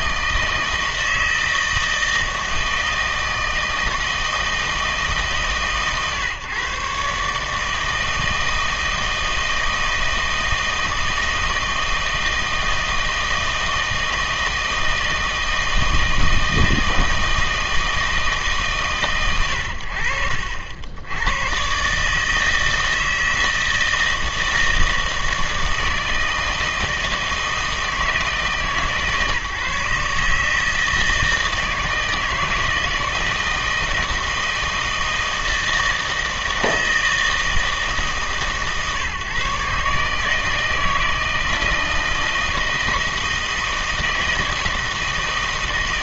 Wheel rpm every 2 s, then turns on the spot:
160, 160, 160, 130, 160, 160, 160, 160, 160, 140, 80, 160, 160, 160, 150, 160, 160, 160, 160, 140, 160, 160, 160.
none